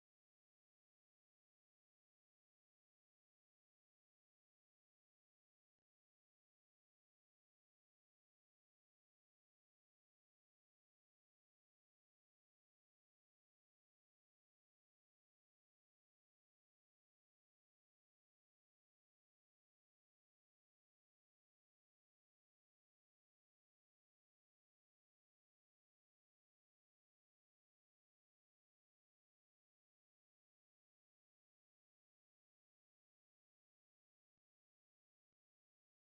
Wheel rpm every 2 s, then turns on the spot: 0, 0, 0, 0, 0, 0, 0, 0, 0, 0, 0, 0, 0, 0, 0, 0, 0, 0.
none